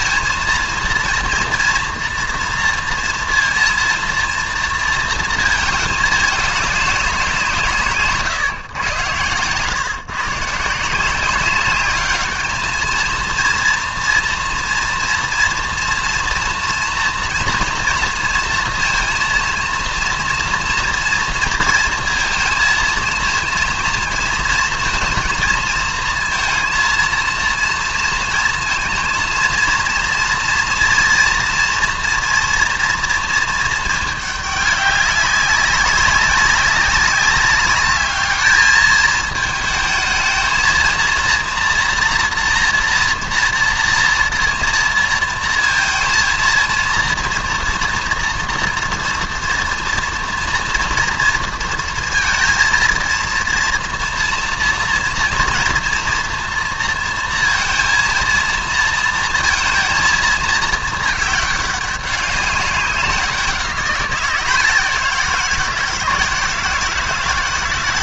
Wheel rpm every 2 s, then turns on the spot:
230, 230, 230, 200, 120, 160, 220, 230, 230, 230, 230, 230, 230, 230, 230, 230, 230, 200, 190, 210, 220, 240, 230, 230, 230, 230, 230, 230, 230, 230, 220, 200, 180, 160.
none